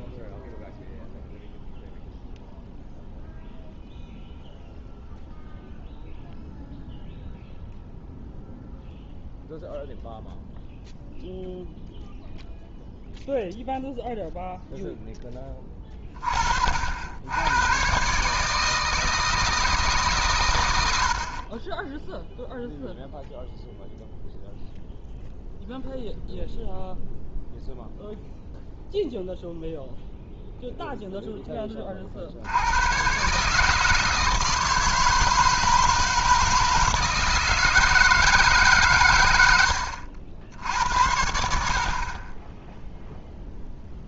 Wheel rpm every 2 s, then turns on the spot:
0, 0, 0, 0, 0, 0, 0, 0, 50, 150, 110, 0, 0, 0, 0, 0, 90, 160, 160, 140, 80, 10.
none